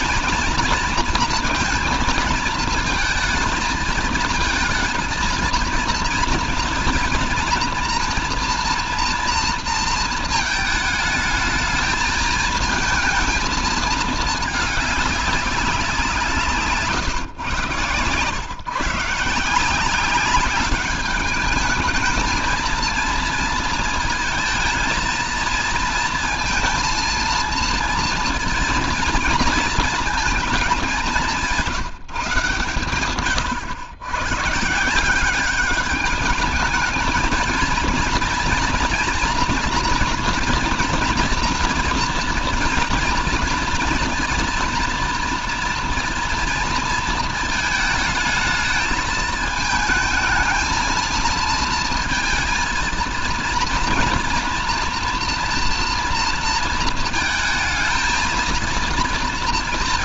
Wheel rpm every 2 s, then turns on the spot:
230, 230, 220, 230, 230, 220, 220, 210, 130, 140, 200, 230, 230, 230, 230, 210, 130, 160, 220, 230, 240, 230, 230, 230, 220, 220, 220, 230, 220, 230.
none